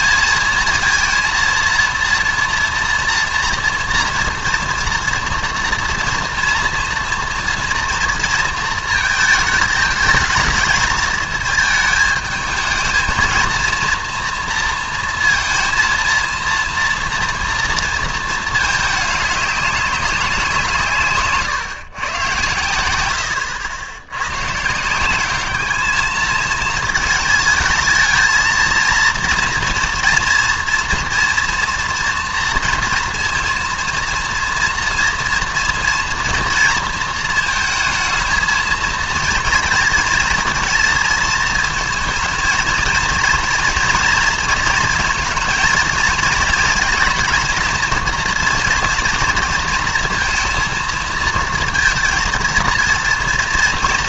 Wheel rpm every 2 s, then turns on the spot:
230, 230, 230, 230, 230, 220, 220, 230, 230, 210, 160, 100, 140, 220, 230, 230, 230, 230, 230, 230, 230, 230, 230, 230, 230, 230, 230.
none